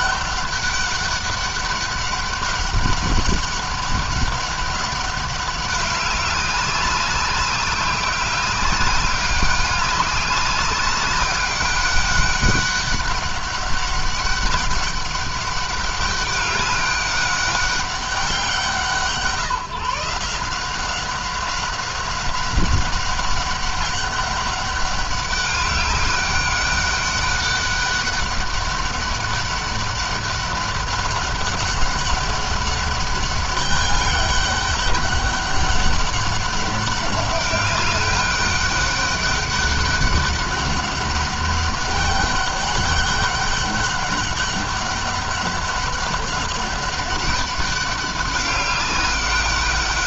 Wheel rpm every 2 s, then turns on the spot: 200, 200, 200, 190, 200, 200, 200, 200, 200, 180, 180, 200, 200, 200, 200, 200, 200, 200, 200, 200, 200, 200, 200, 190, 200.
none